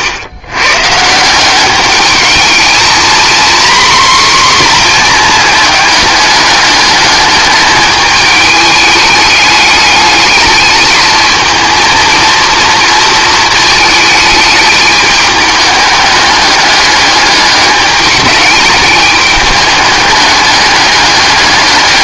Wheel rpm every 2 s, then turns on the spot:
130, 230, 250, 210, 210, 220, 230, 210, 210, 210, 210.
none